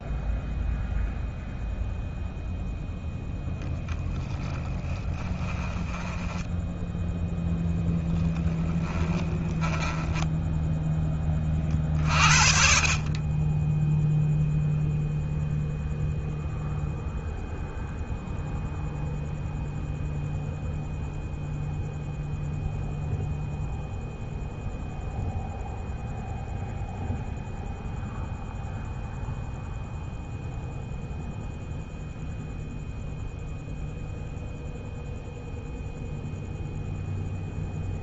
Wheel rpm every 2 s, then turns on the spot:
0, 0, 20, 10, 20, 20, 40, 0, 0, 0, 0, 0, 0, 0, 0, 0, 0, 0, 0.
4-6 8-10